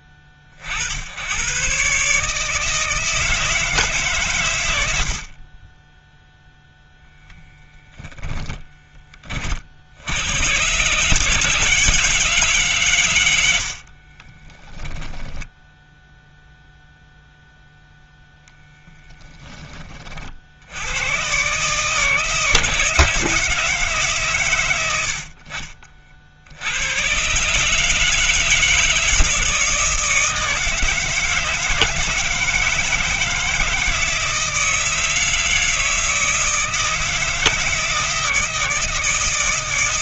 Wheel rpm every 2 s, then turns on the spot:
50, 160, 100, 0, 10, 120, 140, 10, 0, 10, 70, 150, 110, 80, 160, 160, 160, 160, 160, 160.
18-20